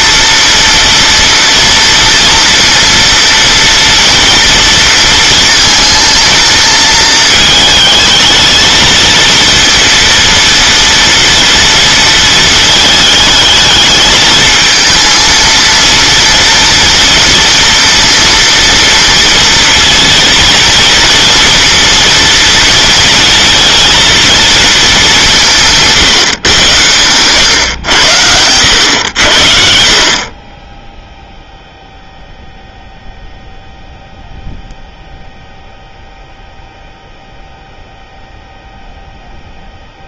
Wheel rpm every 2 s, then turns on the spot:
230, 230, 230, 230, 230, 230, 220, 230, 230, 230, 230, 230, 210, 110, 90, 10, 0, 0, 0, 0.
none